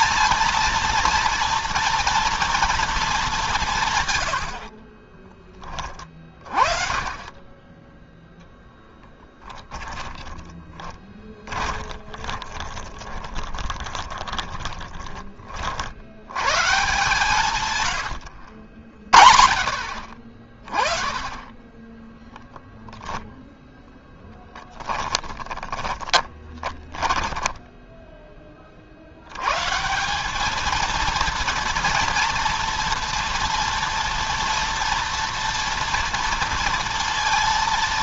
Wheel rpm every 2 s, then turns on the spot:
230, 230, 50, 30, 0, 10, 20, 20, 120, 70, 40, 10, 10, 20, 40, 220, 230, 230, 230.
4-6 10-16 22-28